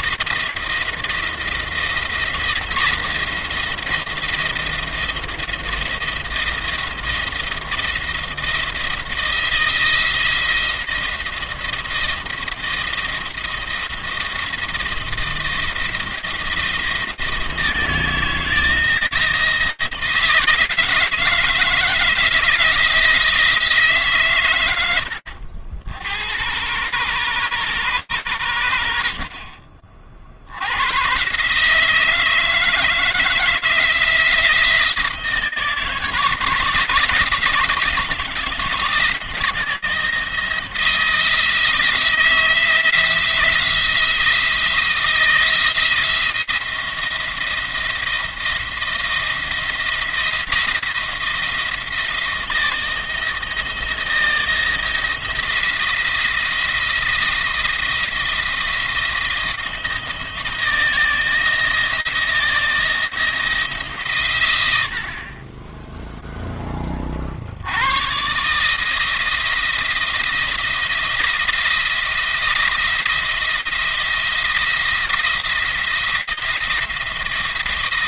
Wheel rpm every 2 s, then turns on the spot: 170, 170, 170, 170, 170, 170, 170, 170, 170, 160, 160, 160, 100, 120, 80, 110, 160, 170, 160, 160, 170, 170, 160, 170, 170, 170, 160, 170, 170, 170, 170, 170, 80, 30, 150, 160, 170, 170, 170.
24-26